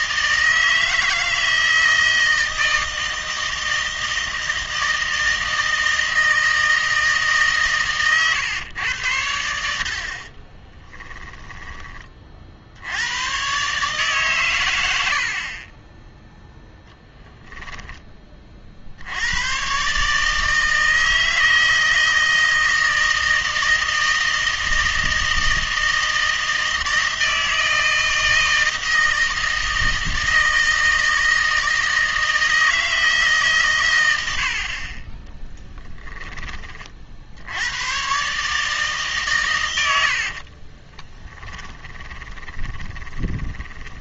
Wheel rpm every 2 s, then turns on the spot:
160, 160, 160, 160, 110, 20, 70, 110, 0, 50, 160, 160, 160, 160, 160, 160, 160, 50, 30, 150, 30, 20.
10-12 40-44